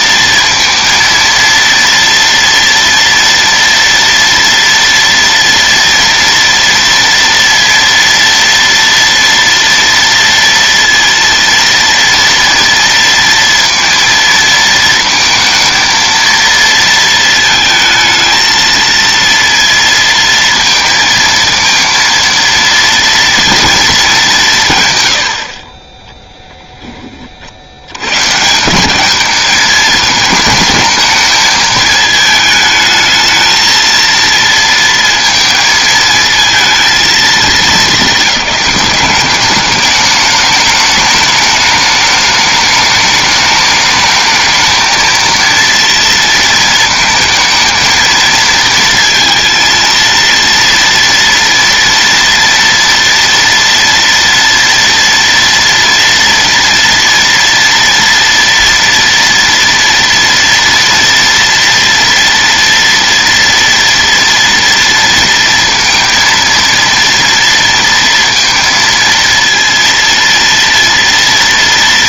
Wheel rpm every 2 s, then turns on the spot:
230, 230, 230, 230, 230, 230, 230, 230, 230, 220, 230, 230, 200, 0, 170, 220, 220, 230, 230, 200, 210, 210, 220, 230, 230, 230, 230, 230, 230, 230, 230, 230, 230, 230, 230, 230.
none